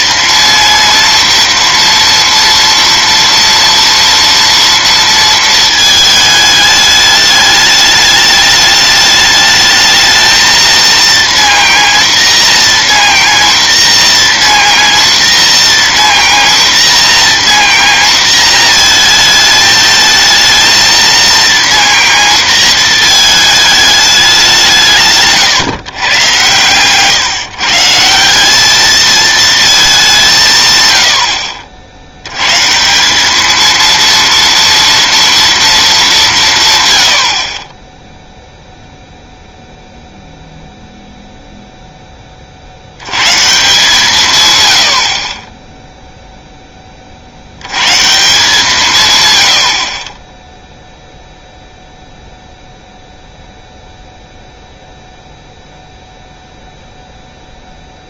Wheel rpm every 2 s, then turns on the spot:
230, 230, 230, 210, 210, 230, 230, 230, 230, 230, 220, 230, 170, 130, 200, 140, 140, 230, 150, 0, 0, 60, 110, 10, 160, 0, 0, 0, 0.
none